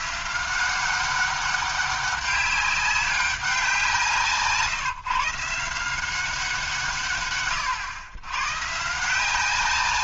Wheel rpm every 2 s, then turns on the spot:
180, 200, 150, 170, 140.
none